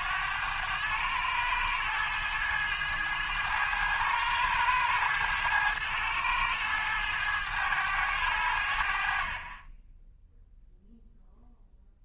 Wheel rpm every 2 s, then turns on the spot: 100, 110, 110, 100, 60, 0.
none